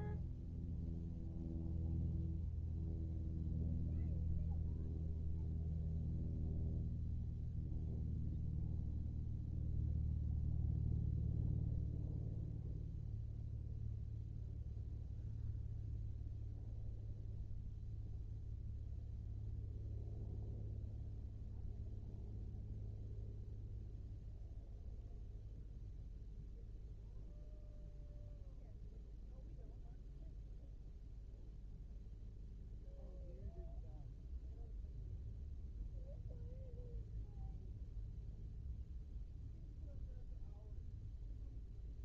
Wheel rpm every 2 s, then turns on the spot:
0, 0, 0, 0, 0, 0, 0, 0, 0, 0, 0, 0, 0, 0, 0, 0, 0, 0, 0, 0, 0.
none